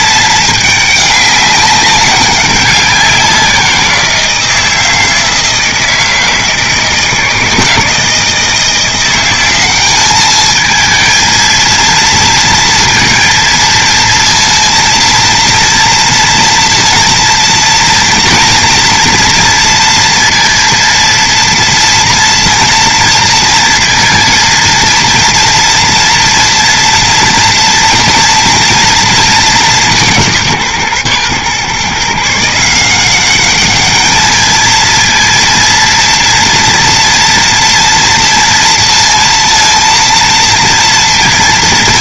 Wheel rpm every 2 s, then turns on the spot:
210, 190, 160, 160, 170, 220, 230, 230, 230, 230, 230, 230, 230, 230, 230, 140, 170, 220, 240, 230, 230.
none